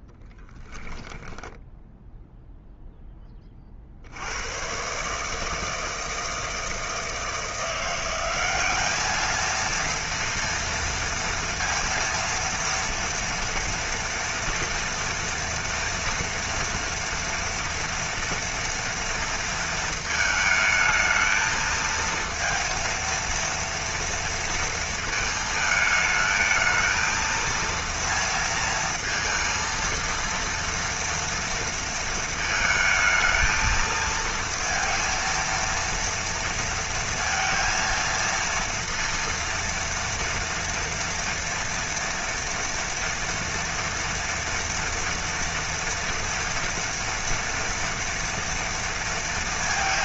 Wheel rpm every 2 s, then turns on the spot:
10, 0, 100, 160, 190, 230, 230, 230, 230, 230, 220, 230, 230, 220, 230, 230, 220, 230, 230, 230, 230, 230, 240, 240, 230.
none